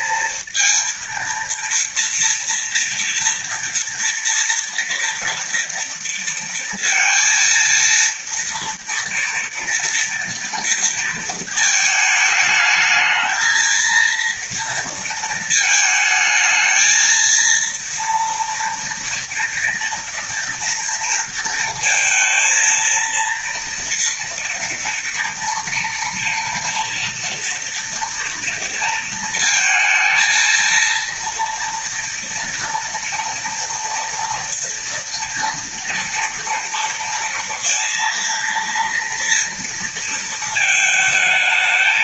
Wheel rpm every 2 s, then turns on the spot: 230, 240, 230, 230, 230, 230, 220, 230, 220, 230, 230, 230, 230, 230, 230, 230, 230, 230, 240, 230, 220.
none